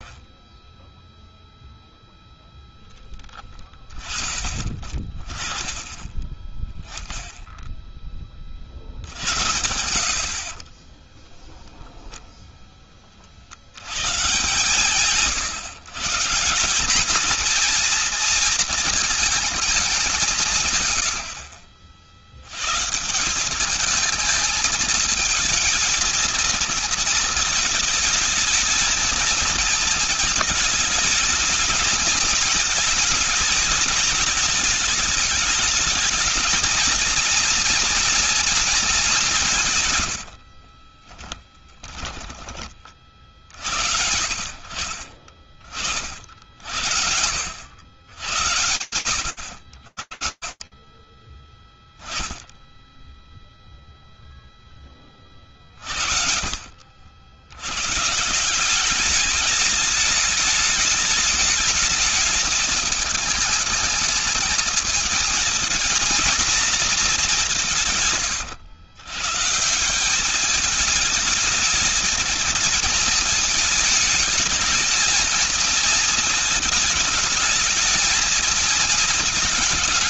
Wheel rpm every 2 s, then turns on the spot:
0, 0, 20, 20, 30, 40, 0, 140, 170, 230, 170, 110, 220, 220, 220, 220, 220, 220, 220, 230, 80, 20, 60, 50, 90, 20, 0, 20, 60, 190, 210, 220, 220, 230, 130, 210, 220, 220, 220, 220.
10-12 40-42